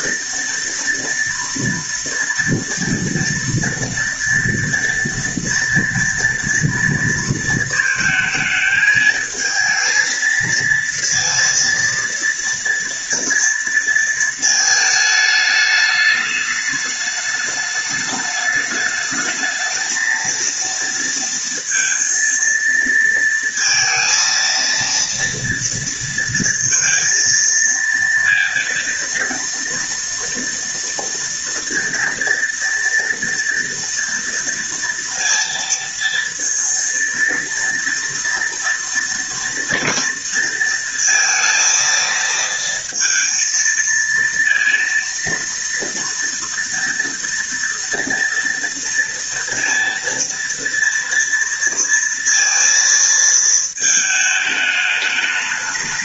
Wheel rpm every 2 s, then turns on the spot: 230, 230, 230, 230, 220, 230, 230, 220, 210, 210, 230, 230, 230, 230, 230, 230, 230, 230, 230, 230, 230, 230, 230, 230, 230, 230, 230, 210.
none